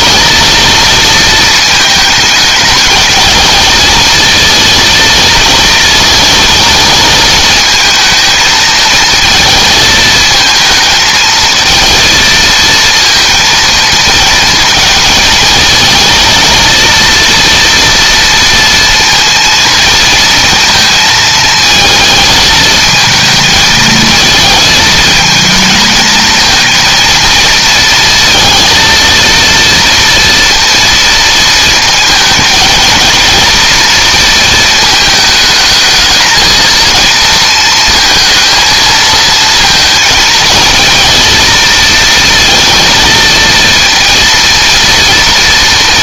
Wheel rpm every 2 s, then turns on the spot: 230, 220, 230, 220, 220, 220, 230, 220, 230, 230, 230, 220, 220, 230, 230, 230, 230, 220, 230, 230, 230, 230, 230.
none